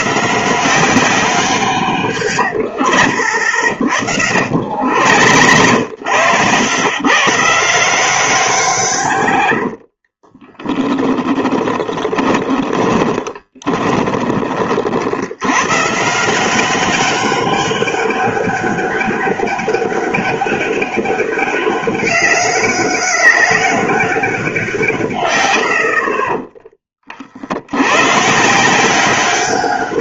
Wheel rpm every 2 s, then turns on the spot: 170, 70, 70, 110, 170, 20, 20, 40, 180, 200, 200, 200, 180, 30, 160.
2-6 10-14 26-28